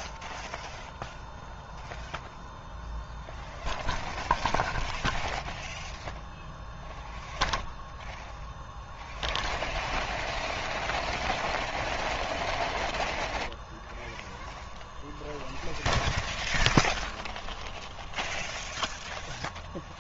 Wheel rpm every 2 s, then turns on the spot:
0, 0, 0, 0, 0, 0, 0, 0, 0, 0.
none